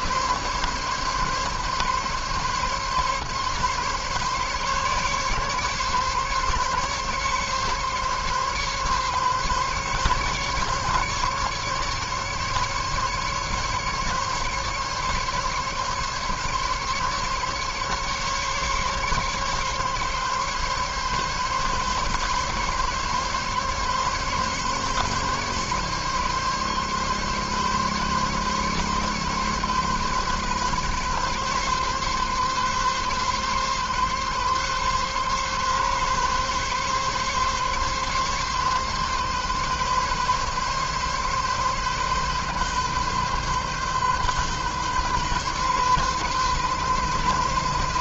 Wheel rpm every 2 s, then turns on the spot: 140, 140, 140, 140, 140, 140, 140, 140, 140, 140, 140, 140, 140, 140, 140, 140, 130, 140, 140, 140, 140, 130, 130, 130.
none